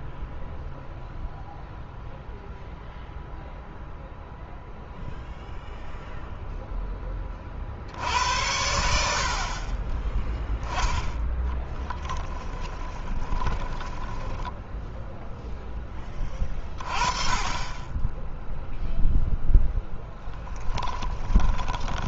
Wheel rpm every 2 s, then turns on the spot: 0, 0, 0, 0, 90, 20, 10, 10, 20, 0, 10.
12-16 20-22